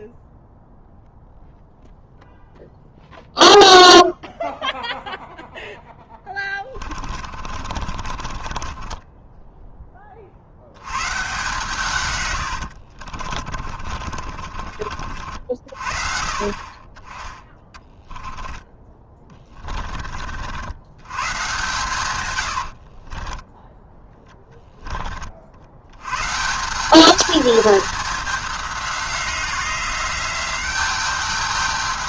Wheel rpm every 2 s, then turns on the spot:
0, 0, 0, 30, 20, 110, 70, 50, 30, 20, 100, 60, 20, 200, 190, 200.
6-10 12-14 22-24